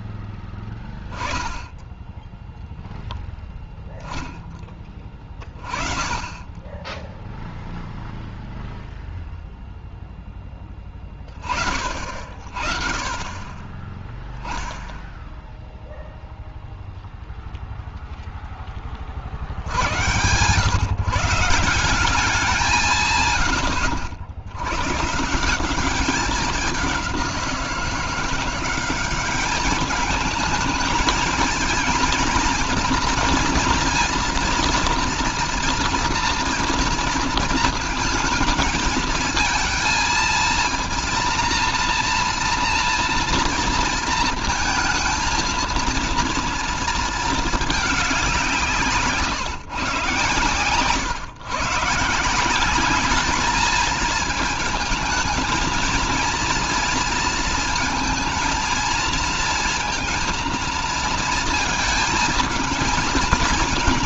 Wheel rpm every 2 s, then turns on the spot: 10, 0, 20, 10, 0, 10, 40, 0, 0, 10, 130, 160, 100, 200, 190, 220, 230, 240, 230, 220, 230, 230, 230, 230, 170, 120, 190, 220, 230, 220, 230, 230.
none